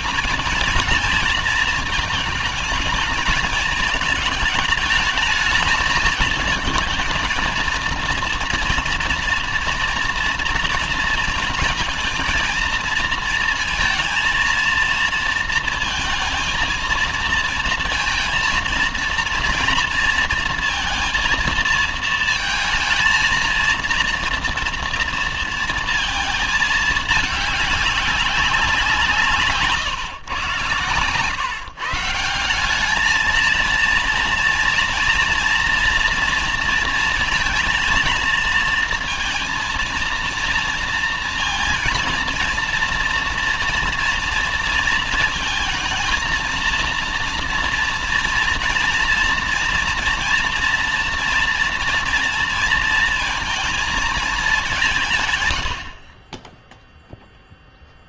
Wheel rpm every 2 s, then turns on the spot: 220, 220, 210, 230, 230, 230, 230, 230, 230, 230, 230, 220, 230, 220, 180, 130, 180, 230, 230, 230, 230, 230, 230, 230, 230, 230, 230, 190, 10.
none